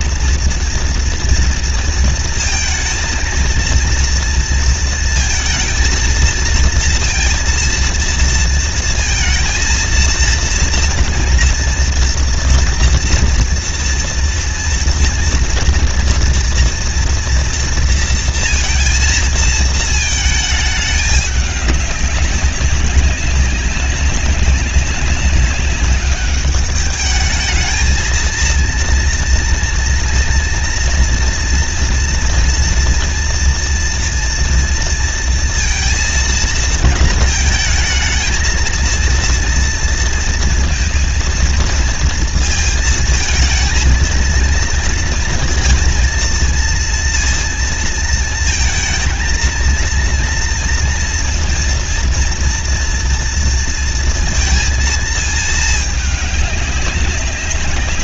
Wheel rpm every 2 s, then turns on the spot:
230, 230, 230, 230, 230, 230, 240, 230, 230, 230, 220, 200, 190, 200, 230, 230, 230, 230, 220, 220, 230, 220, 230, 230, 230, 230, 230, 230, 200.
none